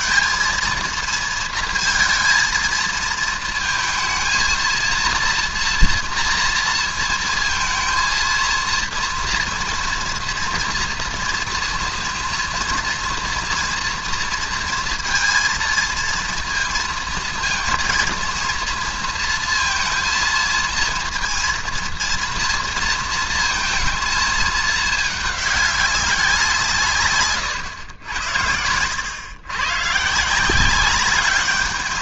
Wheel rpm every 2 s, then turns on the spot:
220, 230, 230, 230, 230, 240, 230, 230, 230, 230, 230, 230, 220, 170, 90, 170.
none